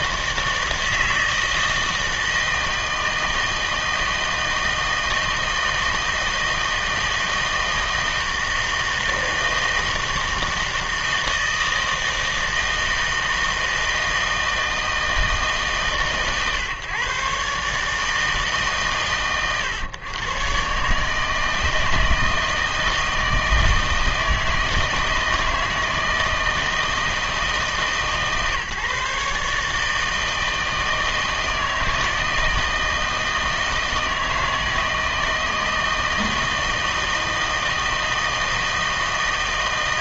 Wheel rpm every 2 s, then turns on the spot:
160, 160, 160, 160, 160, 160, 160, 160, 130, 140, 130, 160, 160, 160, 150, 160, 160, 160, 160, 160.
none